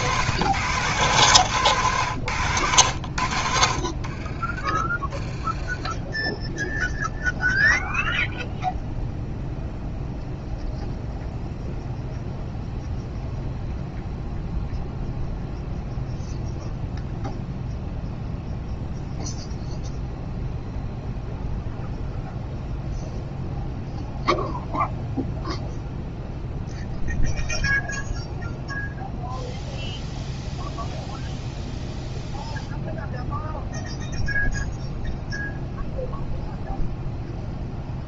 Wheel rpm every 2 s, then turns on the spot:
120, 80, 20, 0, 0, 0, 0, 0, 0, 0, 0, 0, 0, 0, 0, 0, 0, 0, 0.
none